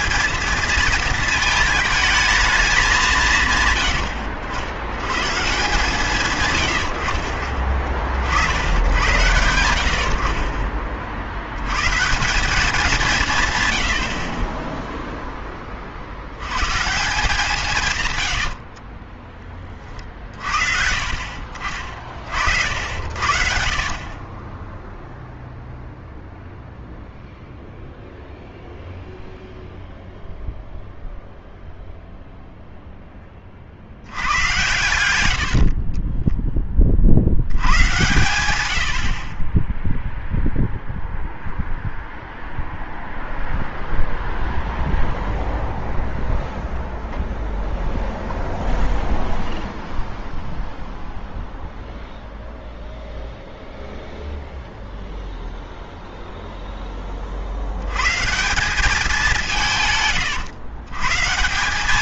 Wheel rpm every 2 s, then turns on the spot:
220, 210, 90, 80, 90, 30, 190, 10, 130, 40, 50, 90, 10, 0, 0, 0, 0, 100, 20, 80, 0, 0, 0, 0, 0, 0, 0, 0, 0, 180, 110.
18-20 38-40